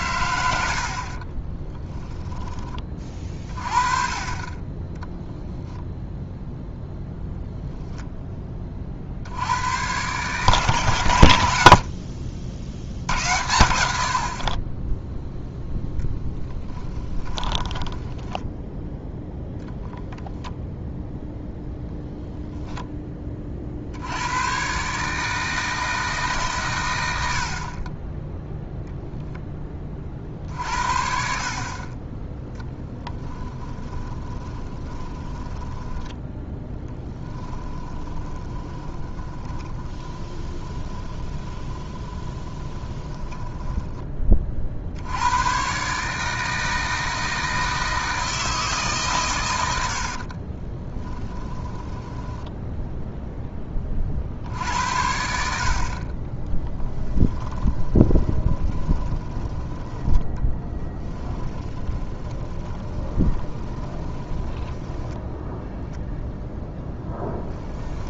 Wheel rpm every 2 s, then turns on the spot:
70, 20, 10, 0, 40, 120, 70, 20, 10, 0, 0, 0, 130, 120, 0, 50, 0, 20, 10, 20, 20, 20, 60, 160, 150, 20, 10, 70, 10, 10, 10, 20, 10, 0.
16-18 34-44 50-52 56-66